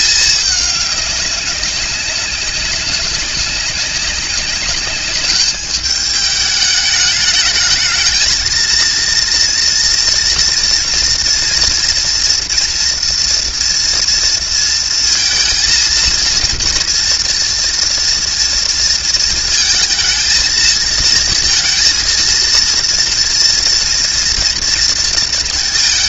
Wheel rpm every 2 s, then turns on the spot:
210, 190, 200, 210, 230, 240, 230, 230, 230, 230, 230, 230, 230.
none